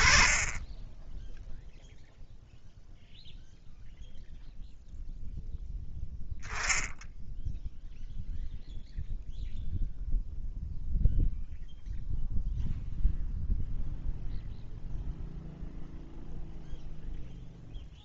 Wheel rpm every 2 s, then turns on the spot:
0, 0, 10, 0, 0, 0, 0, 0, 0.
none